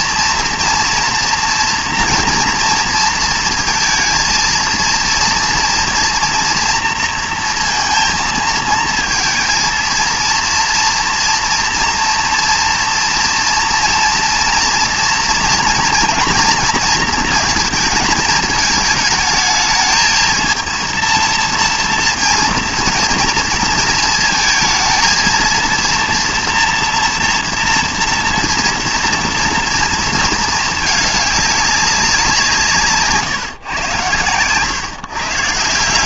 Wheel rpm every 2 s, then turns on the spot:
230, 230, 230, 230, 230, 230, 230, 230, 230, 220, 230, 230, 230, 230, 230, 220, 160, 120.
none